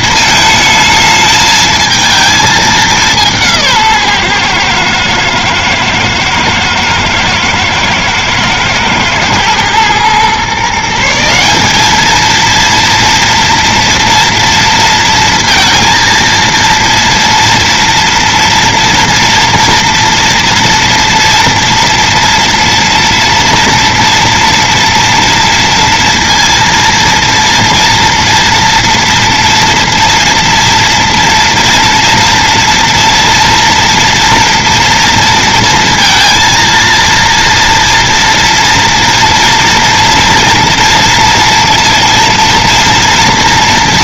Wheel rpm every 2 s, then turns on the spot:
220, 210, 120, 110, 110, 150, 230, 230, 230, 230, 230, 230, 230, 230, 230, 230, 230, 230, 230, 230, 230, 230.
none